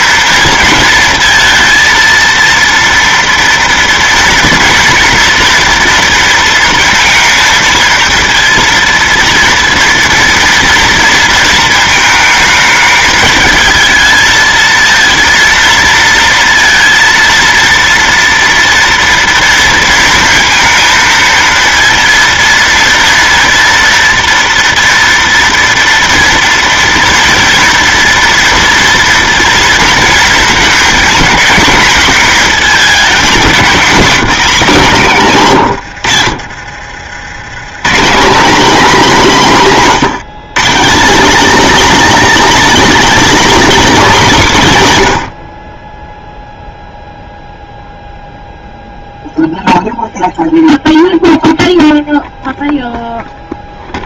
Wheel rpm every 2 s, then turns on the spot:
230, 230, 230, 230, 230, 230, 220, 230, 230, 230, 230, 230, 230, 230, 230, 230, 220, 200, 60, 250, 200, 290, 180, 0, 0, 0, 0.
36-38